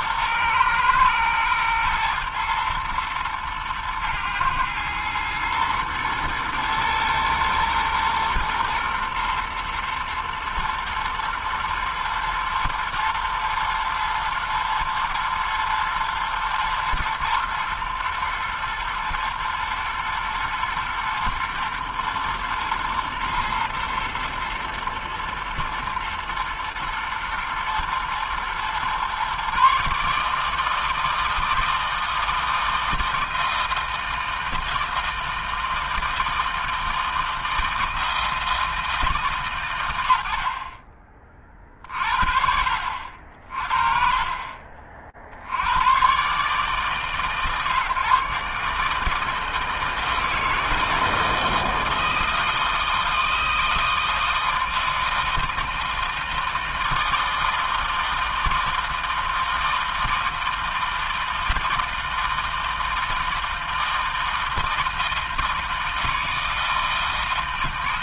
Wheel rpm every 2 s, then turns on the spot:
120, 120, 110, 120, 120, 110, 110, 110, 110, 110, 110, 120, 110, 110, 110, 150, 160, 160, 160, 160, 90, 50, 40, 140, 150, 160, 160, 160, 160, 160, 160, 160, 160, 160.
none